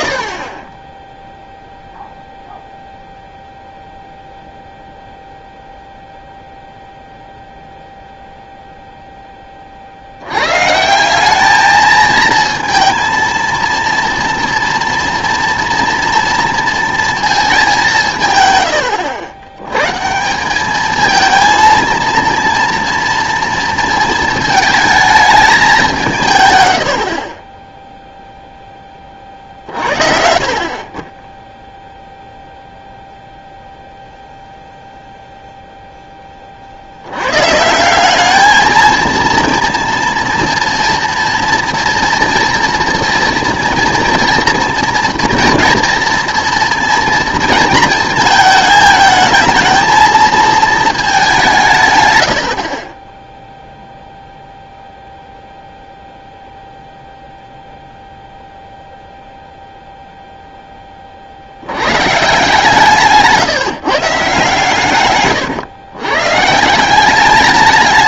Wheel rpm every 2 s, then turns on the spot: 10, 0, 0, 0, 0, 130, 230, 230, 230, 100, 200, 230, 220, 100, 10, 50, 0, 0, 50, 220, 230, 230, 230, 230, 220, 220, 60, 0, 0, 0, 10, 150, 130, 160.
26-28